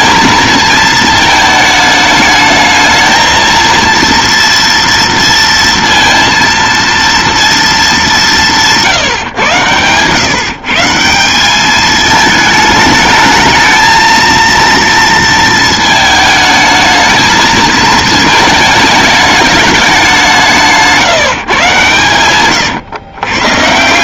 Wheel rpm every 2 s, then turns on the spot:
220, 220, 230, 230, 140, 150, 220, 230, 220, 210, 170, 120.
none